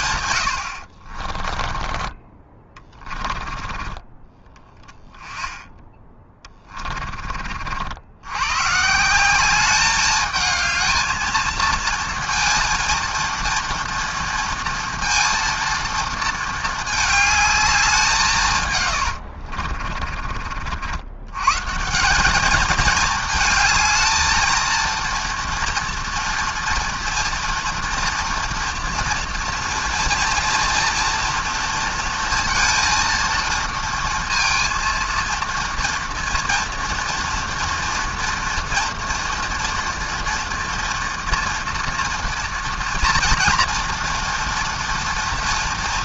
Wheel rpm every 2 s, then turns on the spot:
60, 10, 20, 30, 150, 220, 230, 230, 220, 130, 80, 220, 230, 230, 230, 240, 230, 230, 230, 230, 230, 230, 230.
0-4 6-8 18-20